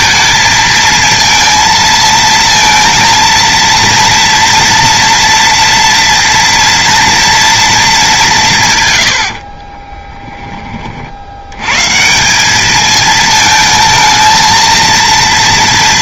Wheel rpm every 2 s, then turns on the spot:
230, 230, 230, 230, 140, 50, 220, 230.
none